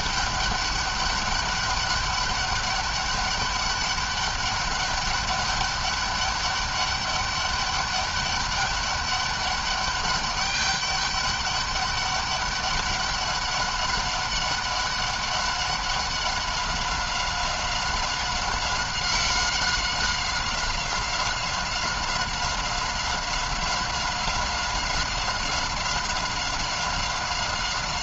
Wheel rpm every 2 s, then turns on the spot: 200, 200, 200, 200, 200, 200, 200, 190, 190, 190, 190, 190, 190, 190.
none